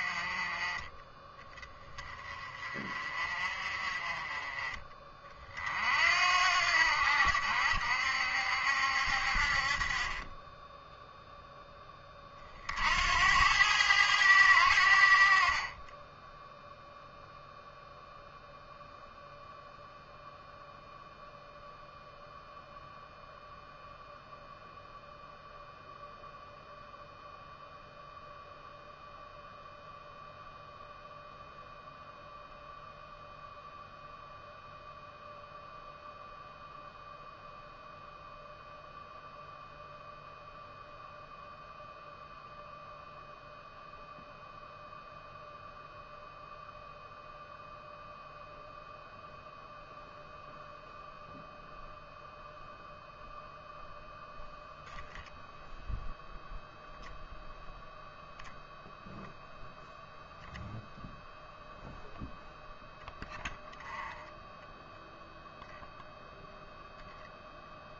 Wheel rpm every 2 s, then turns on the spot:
20, 30, 30, 80, 60, 10, 70, 80, 0, 0, 0, 0, 0, 0, 0, 0, 0, 0, 0, 0, 0, 0, 0, 0, 0, 0, 0, 0, 0, 0, 0, 0, 0, 0.
none